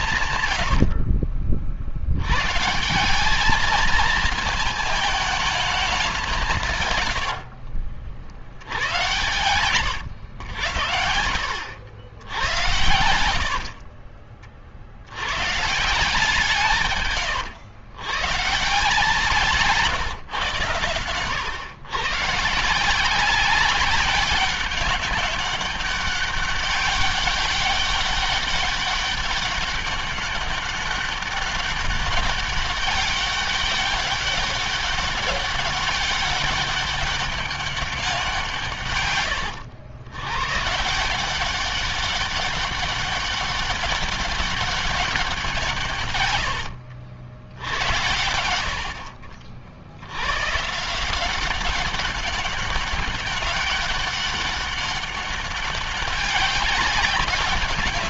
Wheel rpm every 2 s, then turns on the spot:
100, 130, 220, 160, 80, 90, 90, 40, 160, 160, 130, 160, 200, 200, 200, 200, 200, 200, 200, 170, 130, 200, 200, 100, 80, 130, 190, 200, 200.
0-2 8-10 46-48